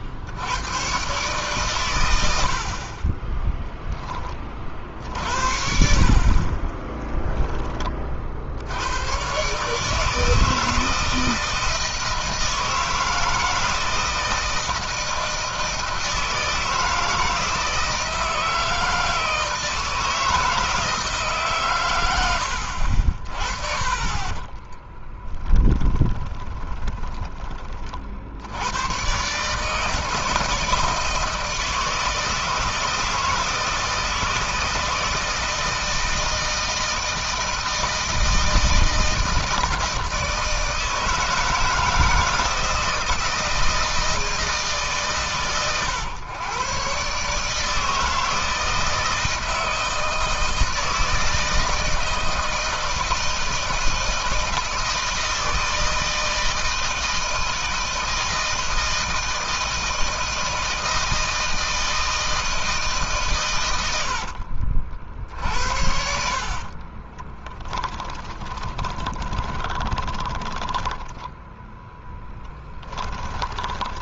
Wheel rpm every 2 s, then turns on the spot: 110, 40, 50, 20, 100, 160, 160, 160, 160, 160, 160, 50, 10, 20, 100, 160, 160, 160, 160, 160, 160, 170, 130, 130, 160, 160, 160, 160, 160, 160, 160, 150, 60, 30, 20, 10, 10.
6-8 24-28 66-74